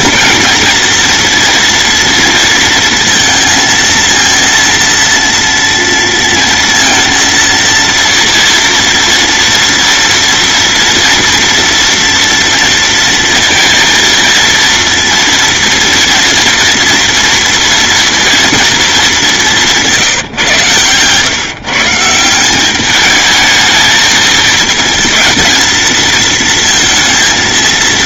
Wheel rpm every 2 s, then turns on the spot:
220, 230, 230, 230, 230, 230, 230, 230, 240, 230, 130, 190, 220, 230.
none